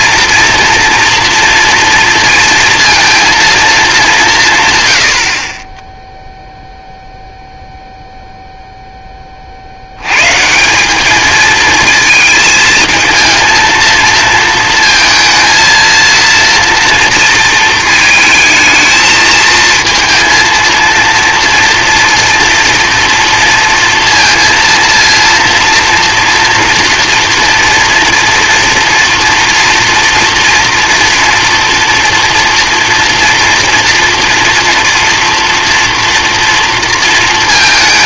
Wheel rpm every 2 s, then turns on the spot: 230, 230, 130, 0, 0, 170, 220, 230, 230, 220, 230, 230, 230, 230, 240, 240, 240, 240, 230.
none